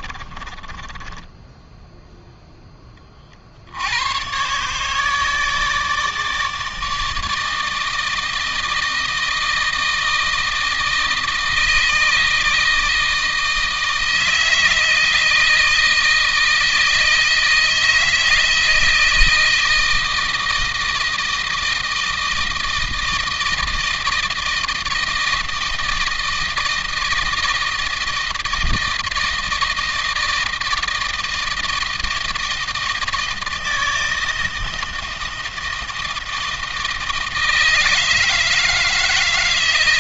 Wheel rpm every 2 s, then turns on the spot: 20, 20, 150, 160, 160, 160, 160, 160, 160, 160, 160, 160, 160, 160, 160, 160, 160, 160, 160, 160.
0-2